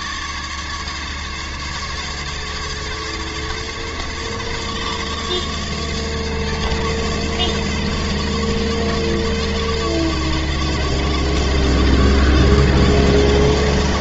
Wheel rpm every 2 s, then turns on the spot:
140, 150, 140, 140, 140, 140, 140.
none